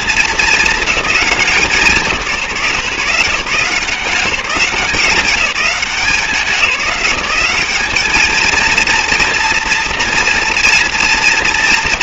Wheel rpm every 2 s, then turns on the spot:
220, 150, 180, 190, 230, 240.
none